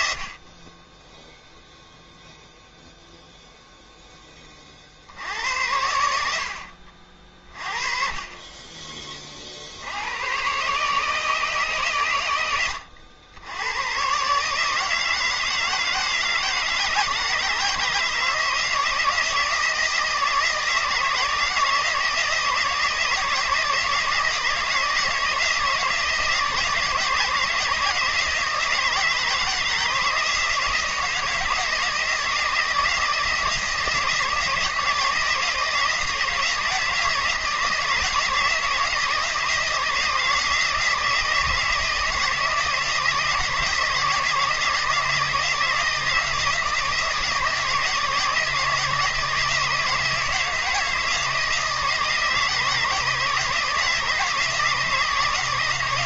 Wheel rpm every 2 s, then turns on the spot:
30, 0, 30, 70, 30, 130, 100, 150, 160, 160, 160, 160, 160, 160, 160, 160, 160, 160, 170, 160, 160, 160, 160, 170, 160, 160, 160, 160.
none